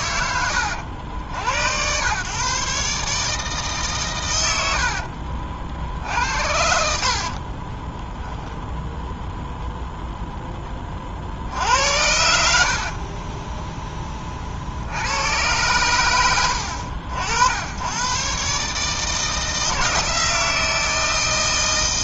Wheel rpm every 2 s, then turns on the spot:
80, 150, 80, 60, 0, 20, 50, 70, 80, 150, 160.
4-8 12-14